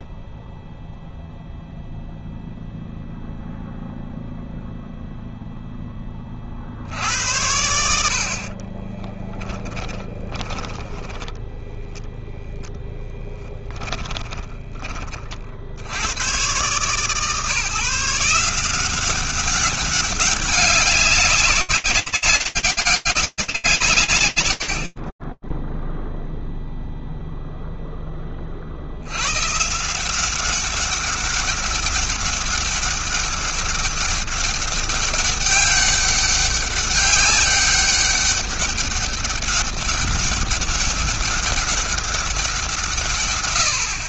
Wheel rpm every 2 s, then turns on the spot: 0, 0, 0, 60, 30, 10, 10, 30, 140, 180, 200, 200, 60, 0, 60, 190, 200, 200, 190, 200, 200, 150.
8-10